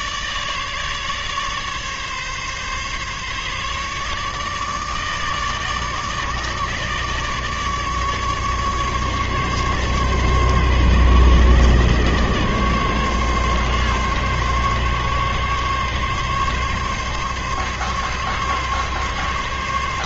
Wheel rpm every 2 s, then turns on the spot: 150, 140, 150, 150, 150, 140, 140, 140, 140, 140.
none